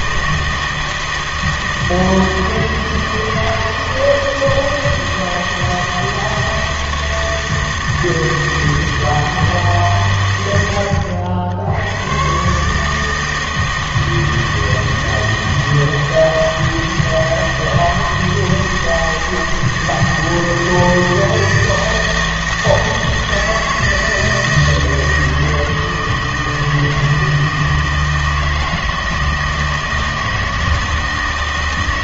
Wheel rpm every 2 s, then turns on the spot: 160, 160, 160, 160, 160, 90, 150, 160, 160, 160, 160, 160, 160, 160, 160, 160.
none